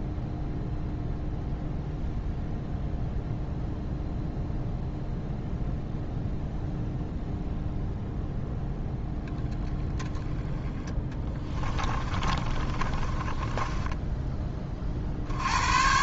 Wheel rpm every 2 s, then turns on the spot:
0, 0, 0, 0, 0, 10, 30, 30.
10-14